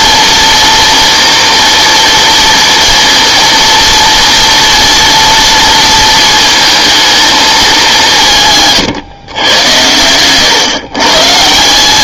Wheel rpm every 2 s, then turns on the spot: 230, 230, 230, 230, 150, 130.
none